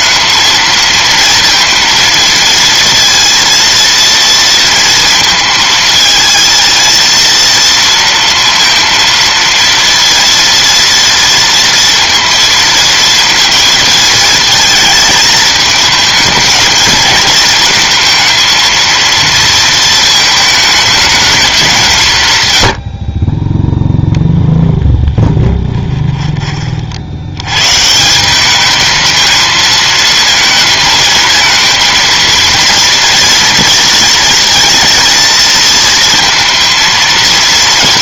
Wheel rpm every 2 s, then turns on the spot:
230, 230, 220, 230, 230, 230, 230, 220, 220, 230, 210, 30, 10, 60, 220, 230, 230, 230, 230.
24-26